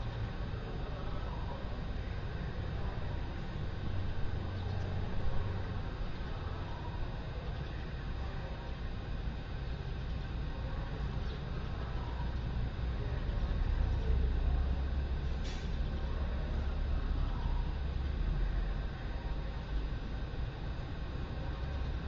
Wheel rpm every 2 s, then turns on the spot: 0, 0, 0, 0, 0, 0, 0, 0, 0, 0, 0.
none